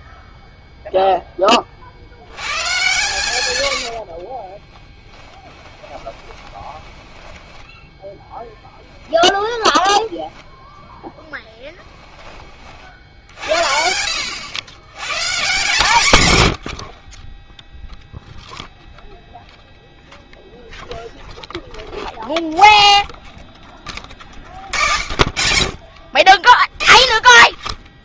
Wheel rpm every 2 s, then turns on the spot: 0, 100, 30, 20, 10, 10, 30, 100, 100, 0, 0, 0, 50, 30.
4-10